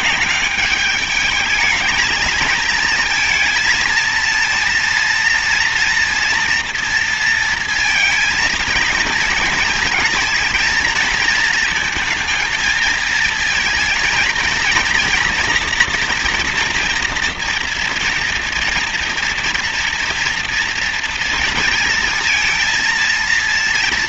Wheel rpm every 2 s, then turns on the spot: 210, 220, 230, 230, 230, 230, 220, 230, 240, 230, 230, 230.
none